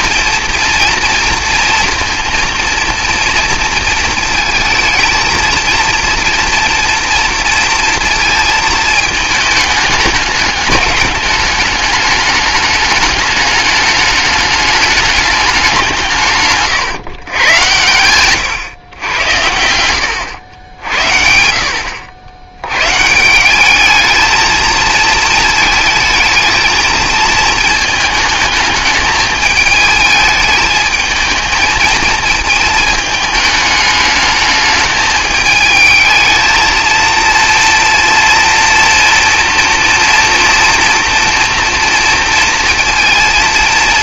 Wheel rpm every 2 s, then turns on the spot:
230, 230, 220, 230, 220, 210, 210, 210, 130, 110, 80, 120, 220, 220, 220, 220, 220, 210, 230, 230, 240, 230.
none